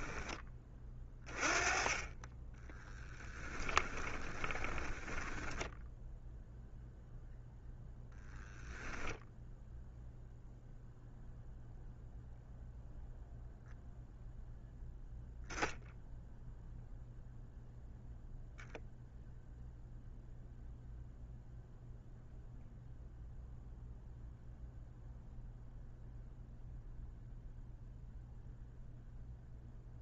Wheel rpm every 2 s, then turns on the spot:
20, 10, 10, 0, 0, 0, 0, 0, 0, 0, 0, 0, 0, 0, 0.
2-6